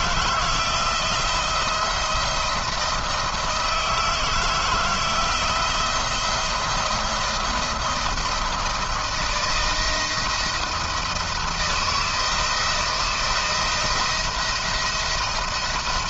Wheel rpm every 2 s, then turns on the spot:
170, 170, 160, 170, 170, 170, 160, 170.
none